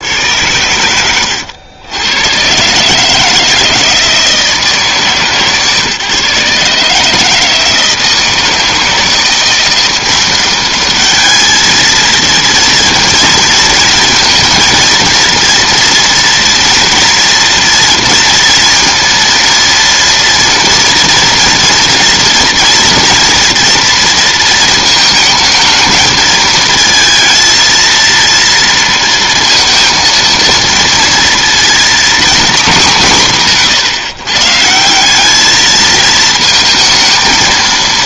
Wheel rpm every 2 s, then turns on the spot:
100, 140, 160, 150, 170, 200, 230, 230, 230, 230, 230, 240, 220, 220, 230, 230, 210, 160, 230.
none